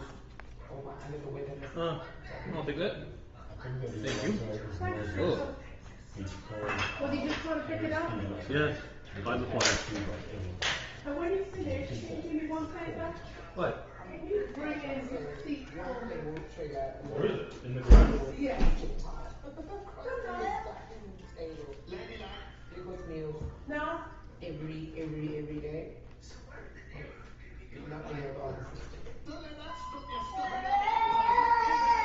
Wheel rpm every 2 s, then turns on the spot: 0, 0, 0, 0, 0, 0, 0, 0, 0, 0, 0, 0, 0, 0, 0, 0.
none